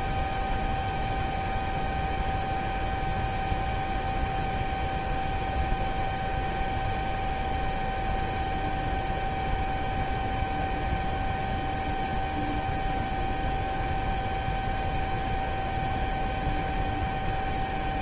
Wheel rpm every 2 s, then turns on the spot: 0, 0, 0, 0, 0, 0, 0, 0, 0.
none